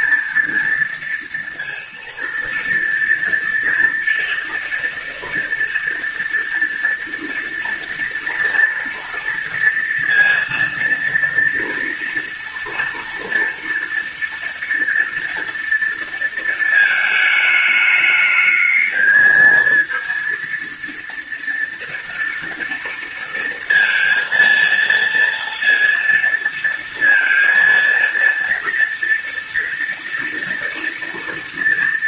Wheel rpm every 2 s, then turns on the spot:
230, 230, 230, 230, 230, 230, 230, 230, 220, 220, 230, 230, 230, 230, 230, 230.
none